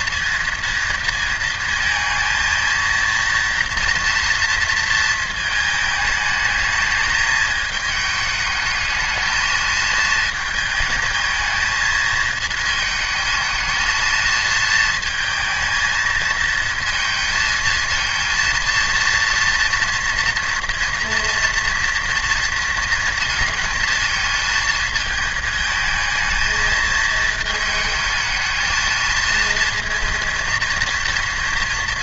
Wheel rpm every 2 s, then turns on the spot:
230, 230, 230, 220, 220, 220, 220, 230, 230, 230, 240, 230, 230, 220, 220, 230.
none